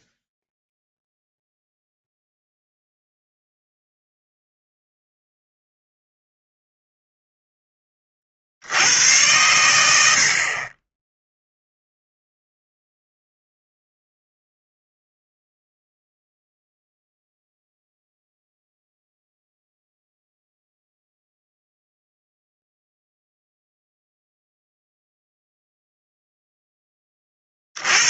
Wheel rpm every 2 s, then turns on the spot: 0, 0, 0, 0, 80, 30, 0, 0, 0, 0, 0, 0, 0, 10.
none